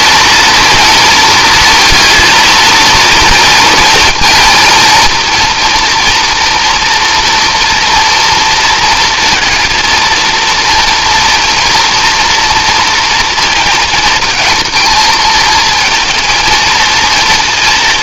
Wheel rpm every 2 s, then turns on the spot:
230, 230, 230, 230, 230, 230, 230, 220, 230.
none